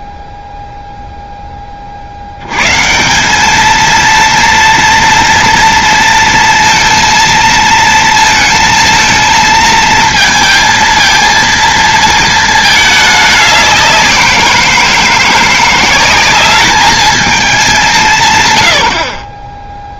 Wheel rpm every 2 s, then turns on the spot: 0, 90, 230, 230, 230, 230, 220, 180, 200, 190.
none